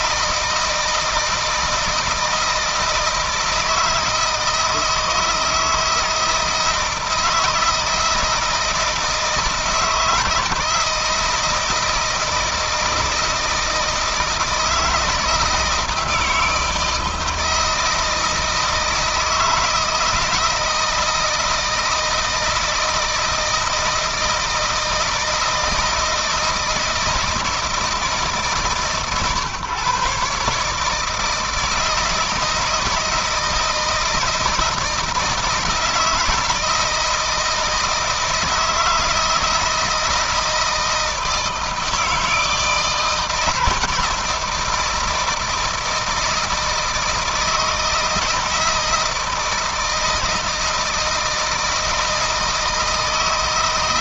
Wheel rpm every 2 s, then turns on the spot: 160, 160, 160, 160, 160, 160, 160, 160, 160, 160, 160, 160, 160, 160, 140, 150, 160, 160, 160, 160, 160, 170, 160, 160, 160, 160, 160.
none